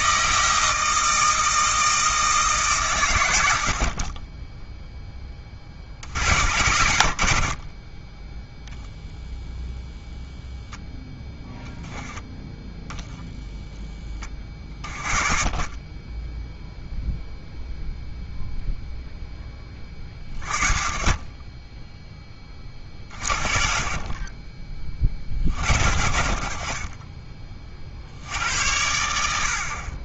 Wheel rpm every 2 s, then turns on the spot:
160, 140, 0, 70, 0, 0, 10, 30, 0, 0, 50, 30, 30, 40, 80.
none